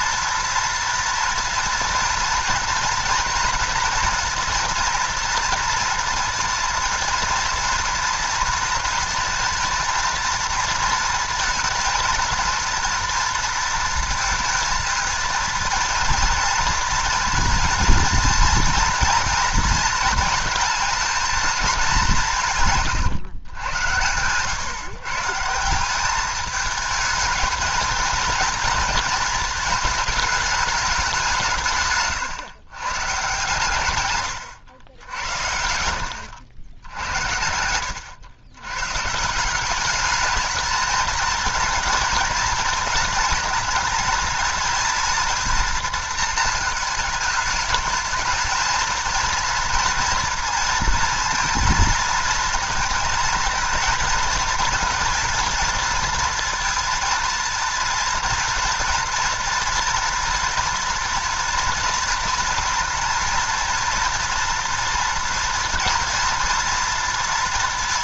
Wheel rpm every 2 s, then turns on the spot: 230, 240, 230, 230, 230, 230, 230, 230, 230, 230, 230, 160, 130, 220, 230, 210, 140, 90, 90, 110, 220, 230, 230, 230, 230, 230, 230, 230, 230, 230, 230, 230, 230, 230.
22-24 36-38